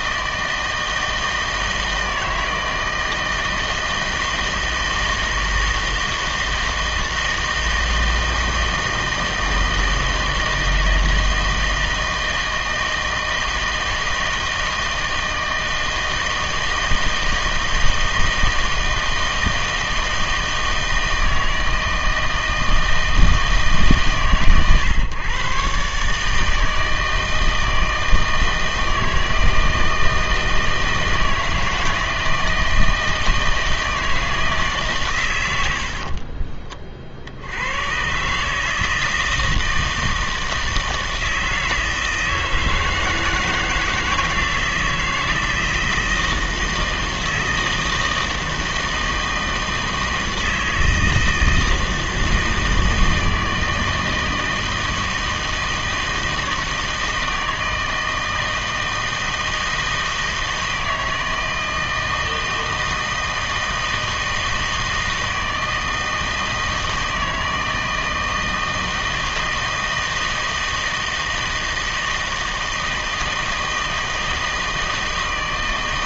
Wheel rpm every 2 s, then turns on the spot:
160, 160, 160, 160, 160, 160, 160, 160, 160, 160, 160, 160, 130, 160, 160, 160, 160, 150, 30, 150, 160, 160, 160, 160, 160, 160, 160, 160, 160, 160, 160, 160, 160, 160, 160, 160, 160, 160.
none